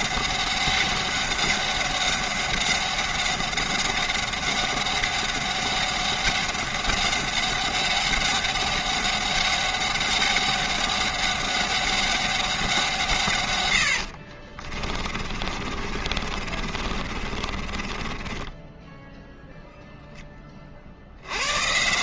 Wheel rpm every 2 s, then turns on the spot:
200, 200, 200, 200, 200, 200, 170, 30, 40, 10, 60.
14-20